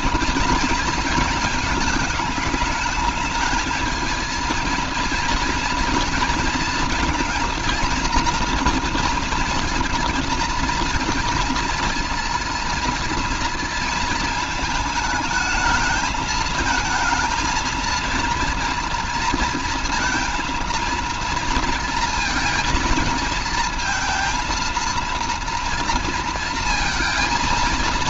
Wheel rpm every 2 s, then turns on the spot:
230, 210, 230, 230, 230, 230, 230, 220, 220, 230, 230, 220, 230, 230.
none